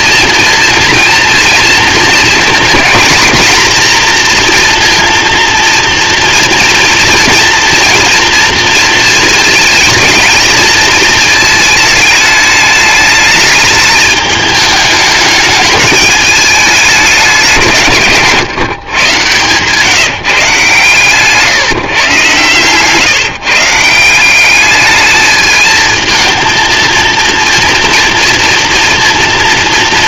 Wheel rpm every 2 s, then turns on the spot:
230, 240, 230, 230, 230, 220, 210, 210, 180, 120, 140, 140, 220, 230, 230.
none